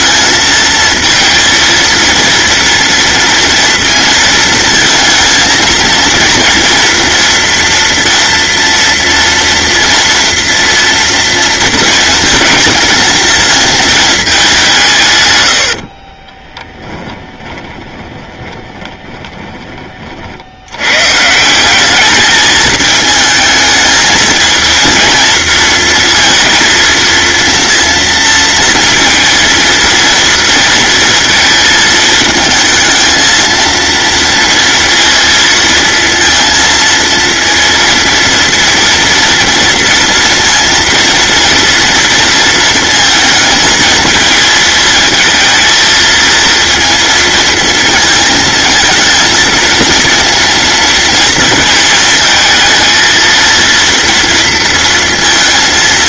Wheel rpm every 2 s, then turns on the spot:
220, 230, 230, 230, 230, 230, 220, 180, 10, 20, 80, 220, 230, 230, 230, 230, 220, 230, 230, 230, 230, 230, 220, 230, 220, 230, 220, 230.
16-20